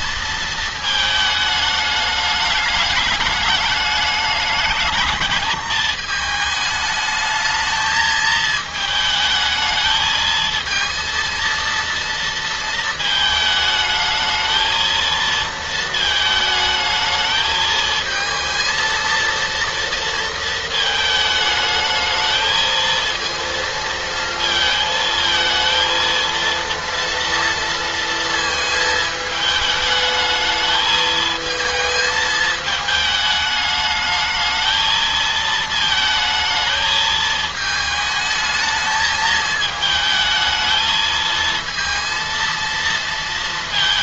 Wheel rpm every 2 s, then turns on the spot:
220, 210, 210, 220, 220, 220, 230, 220, 220, 230, 230, 220, 230, 230, 220, 210, 220, 220, 220, 220, 220, 230.
none